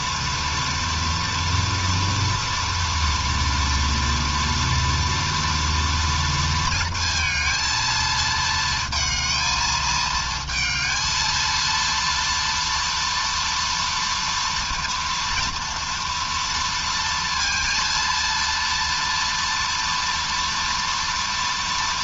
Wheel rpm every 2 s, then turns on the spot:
230, 230, 230, 230, 220, 220, 230, 230, 230, 230, 230.
none